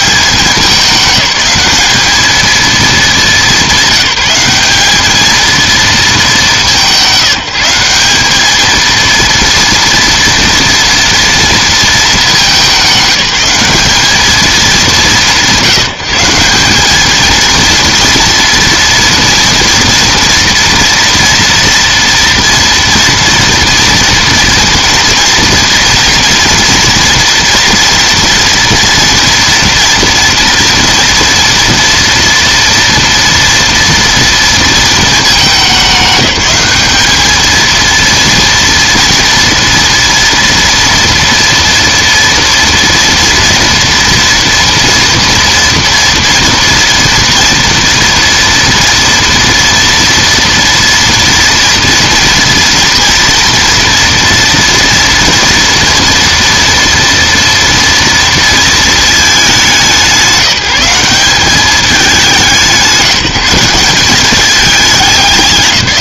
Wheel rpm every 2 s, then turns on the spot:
200, 220, 200, 190, 220, 230, 200, 200, 210, 230, 240, 230, 240, 240, 230, 230, 230, 220, 200, 230, 230, 230, 230, 240, 230, 230, 240, 230, 230, 230, 190, 170, 200.
none